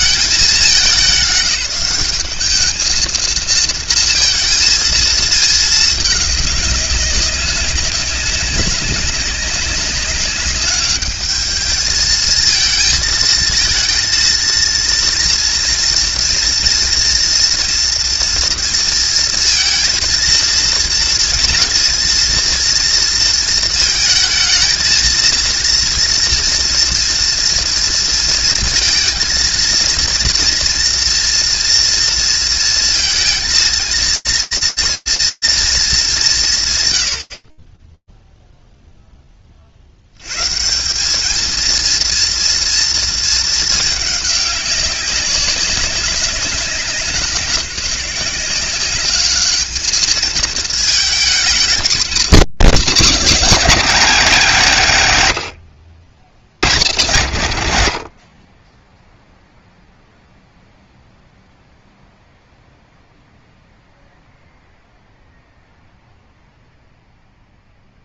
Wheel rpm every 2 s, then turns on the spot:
180, 220, 230, 200, 190, 200, 220, 230, 230, 230, 230, 230, 230, 240, 230, 230, 230, 230, 140, 0, 170, 230, 200, 170, 200, 220, 270, 200, 120, 0, 0, 0, 0, 0.
none